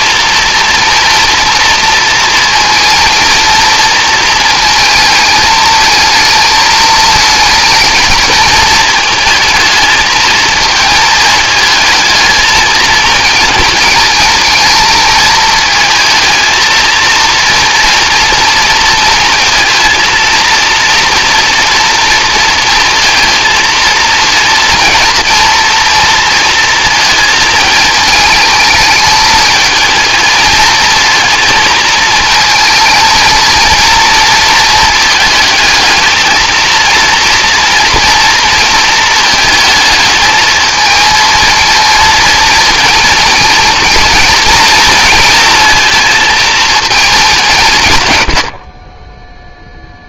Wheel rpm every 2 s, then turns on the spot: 230, 230, 220, 220, 220, 220, 230, 220, 220, 230, 230, 230, 230, 230, 220, 220, 220, 230, 230, 230, 220, 230, 230, 230, 50.
none